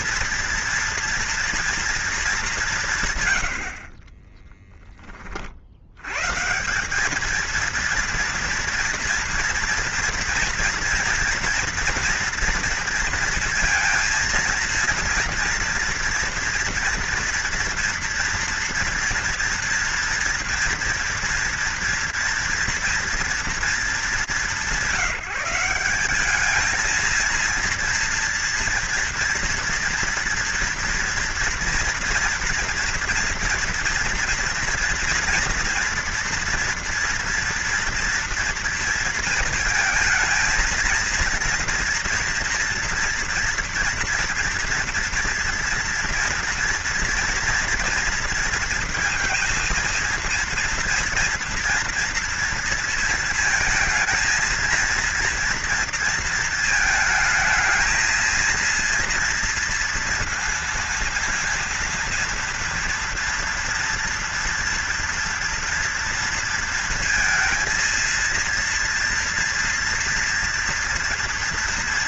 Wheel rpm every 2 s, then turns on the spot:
240, 150, 20, 200, 230, 240, 230, 230, 240, 240, 240, 240, 180, 220, 230, 230, 240, 240, 230, 230, 230, 230, 230, 240, 230, 230, 230, 230, 220, 230, 230, 230, 240, 230, 230, 230.
none